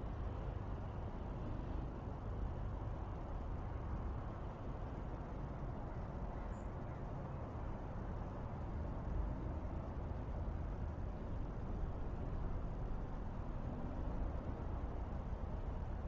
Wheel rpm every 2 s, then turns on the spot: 0, 0, 0, 0, 0, 0, 0, 0.
none